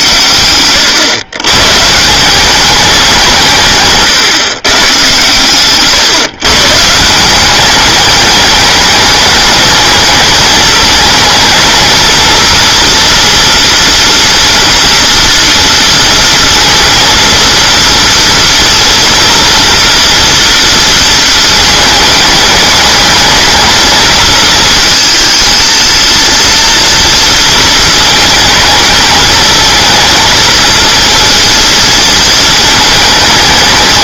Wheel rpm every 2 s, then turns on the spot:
110, 200, 130, 160, 210, 220, 230, 240, 230, 240, 230, 210, 220, 230, 220, 230, 220.
none